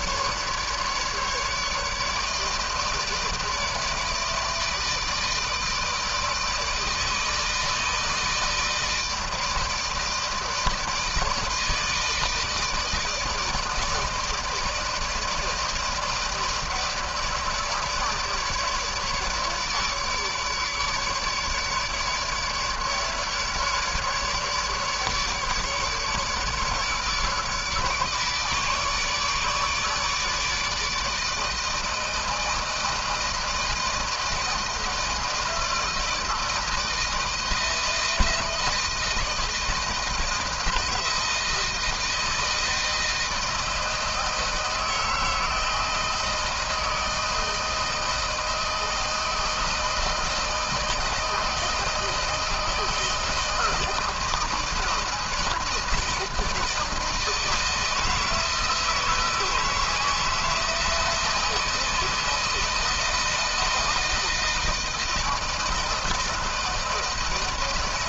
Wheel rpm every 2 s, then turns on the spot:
150, 160, 160, 160, 160, 160, 160, 160, 160, 150, 150, 150, 150, 150, 150, 150, 160, 160, 160, 160, 160, 160, 160, 160, 160, 160, 160, 160, 160, 160, 160, 160, 160, 160.
none